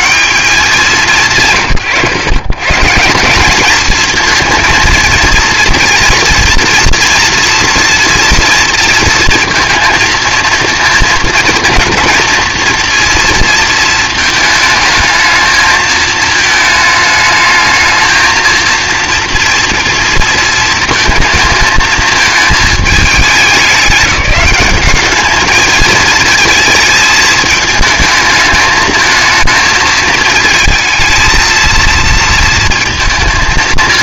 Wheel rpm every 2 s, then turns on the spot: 190, 130, 230, 230, 230, 230, 230, 220, 220, 230, 230, 210, 200, 220, 220, 220, 230.
none